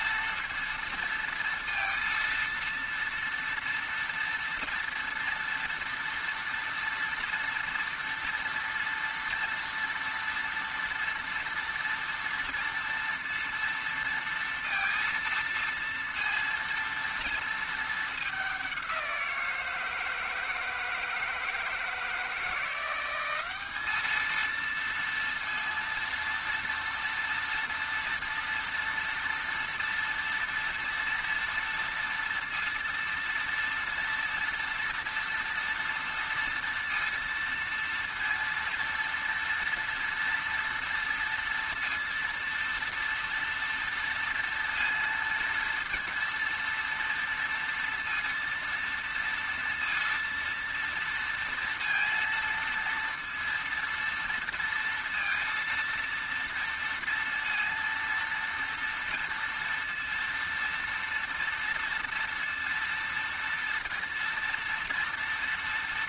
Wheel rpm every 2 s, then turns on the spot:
230, 230, 230, 230, 230, 230, 230, 230, 230, 190, 160, 170, 230, 230, 230, 230, 230, 230, 230, 230, 230, 230, 230, 230, 230, 230, 230, 230, 230, 230, 230, 230, 230.
none